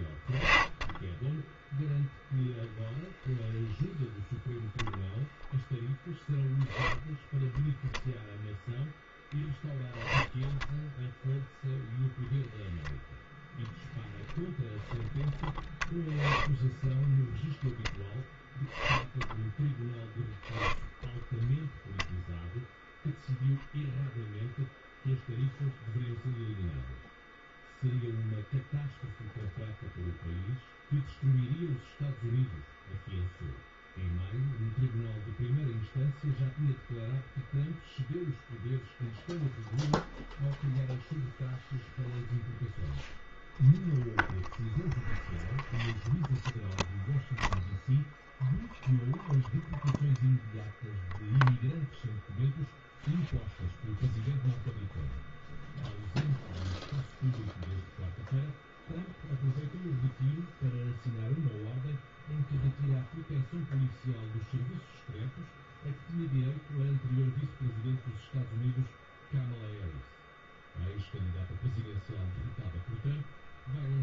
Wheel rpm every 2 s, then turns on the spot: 10, 0, 0, 10, 0, 10, 0, 10, 10, 10, 0, 0, 0, 0, 0, 0, 0, 0, 0, 0, 0, 0, 0, 0, 0, 0, 0, 0, 0, 0, 0, 0, 0, 0, 0, 0, 0.
none